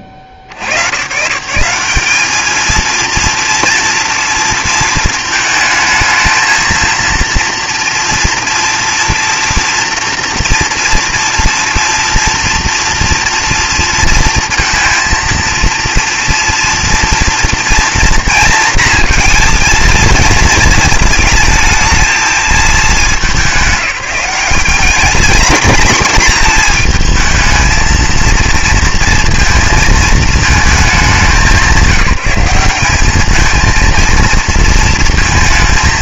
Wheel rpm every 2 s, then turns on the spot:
90, 220, 230, 230, 240, 230, 230, 230, 240, 230, 220, 220, 220, 230, 230, 210, 200, 230.
none